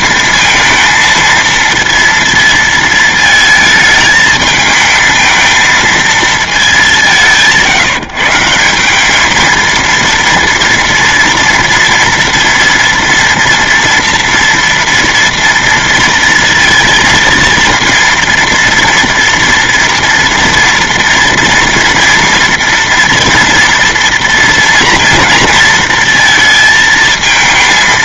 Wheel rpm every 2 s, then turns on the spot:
230, 230, 220, 210, 170, 230, 230, 230, 230, 230, 230, 230, 230, 230.
none